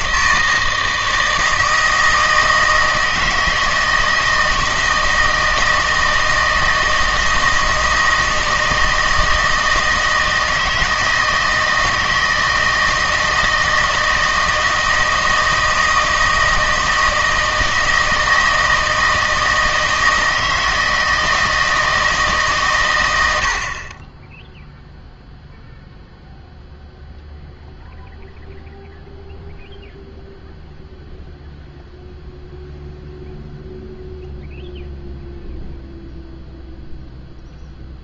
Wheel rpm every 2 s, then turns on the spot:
160, 160, 160, 160, 160, 160, 160, 160, 160, 160, 160, 130, 0, 0, 0, 0, 0, 0, 0.
none